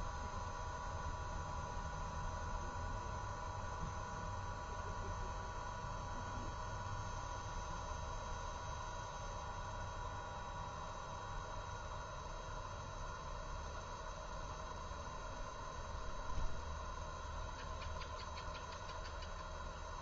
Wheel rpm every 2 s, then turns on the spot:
0, 0, 0, 0, 0, 0, 0, 0, 0, 0.
none